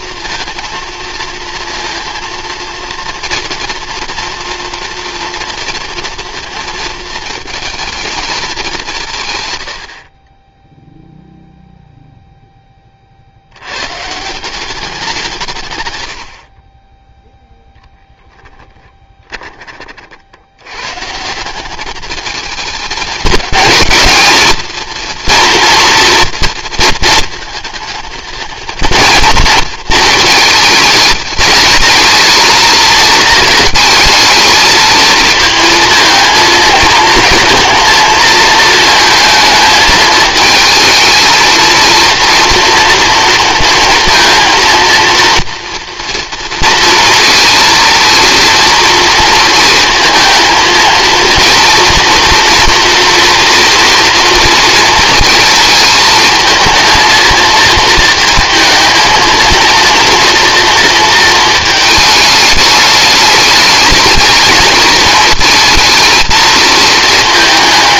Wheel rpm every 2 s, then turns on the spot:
230, 230, 230, 220, 190, 0, 20, 190, 20, 10, 110, 210, 230, 230, 230, 220, 220, 220, 220, 220, 220, 230, 230, 230, 230, 230, 240, 230, 220, 230, 230, 210, 220, 220.
18-20